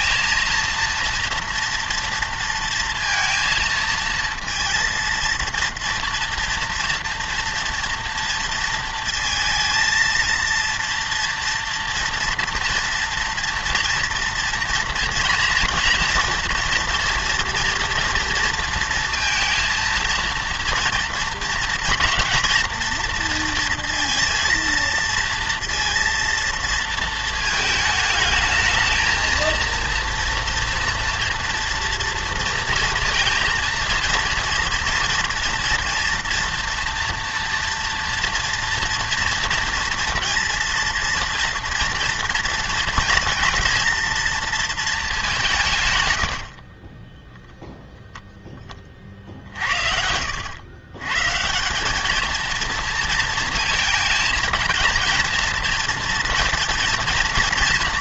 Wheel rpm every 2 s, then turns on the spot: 230, 230, 230, 230, 230, 230, 230, 230, 230, 230, 230, 230, 230, 230, 220, 230, 230, 230, 230, 230, 230, 230, 230, 50, 20, 110, 230, 220, 230.
46-48